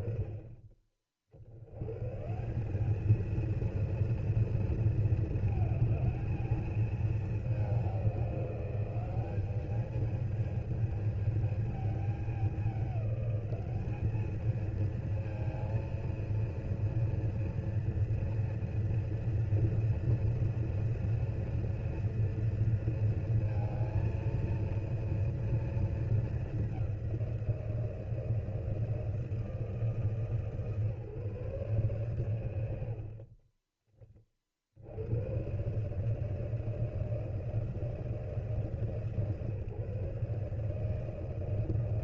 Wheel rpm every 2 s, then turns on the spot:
70, 220, 220, 210, 200, 220, 200, 230, 230, 240, 240, 230, 230, 200, 160, 140, 80, 70, 160, 150, 150.
none